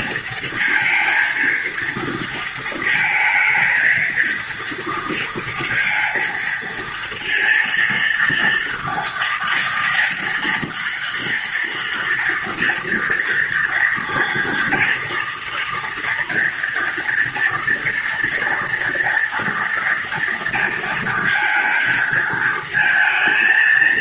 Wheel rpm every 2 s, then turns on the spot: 230, 230, 230, 230, 230, 230, 230, 230, 240, 230, 230, 230.
none